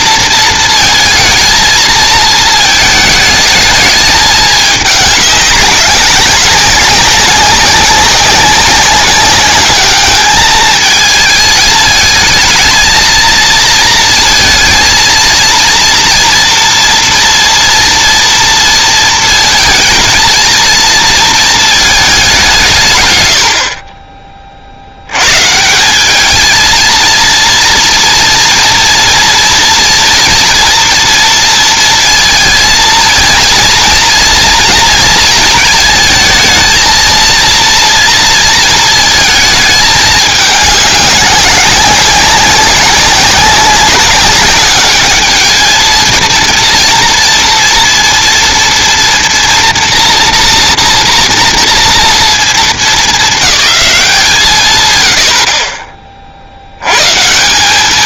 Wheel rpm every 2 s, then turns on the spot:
230, 220, 210, 200, 200, 220, 220, 230, 240, 230, 230, 170, 60, 230, 230, 230, 230, 230, 230, 220, 210, 200, 200, 230, 230, 230, 220, 140, 80.
none